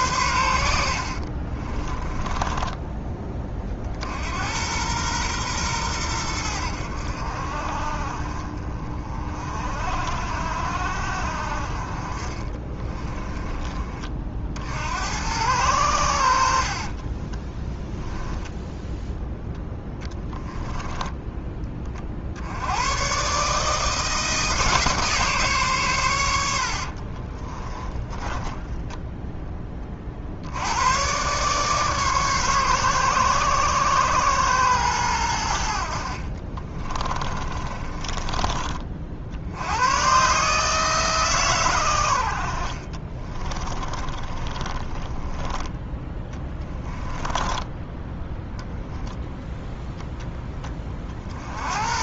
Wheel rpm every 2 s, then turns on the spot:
70, 10, 110, 70, 40, 60, 20, 80, 40, 0, 10, 110, 150, 60, 10, 100, 130, 110, 30, 50, 150, 40, 20, 10, 0, 30.
0-2 12-14 16-18 20-22 26-30 36-38 42-48